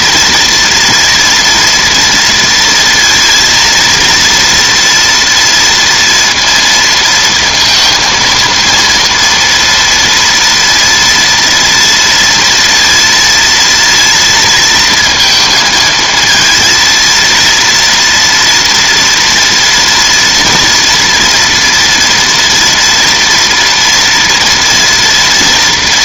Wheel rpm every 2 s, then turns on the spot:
230, 230, 240, 230, 230, 230, 230, 230, 230, 230, 230, 230, 230.
none